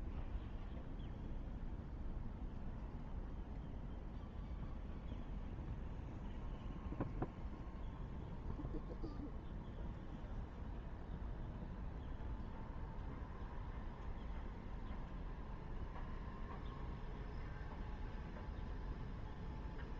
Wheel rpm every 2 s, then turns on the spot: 0, 0, 0, 0, 0, 0, 0, 0, 0, 0.
none